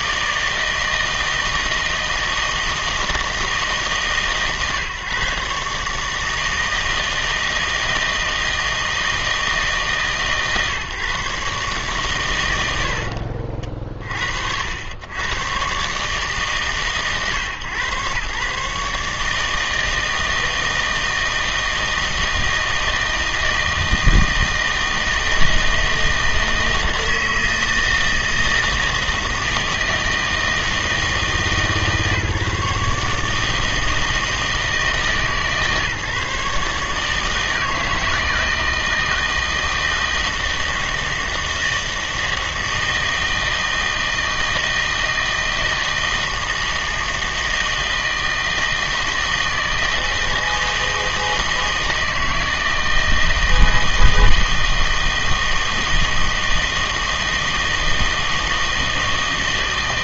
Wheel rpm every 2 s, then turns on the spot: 160, 160, 120, 160, 160, 130, 70, 70, 130, 150, 160, 160, 160, 160, 160, 160, 150, 160, 150, 160, 160, 160, 160, 160, 160, 160, 160, 160, 160, 160.
none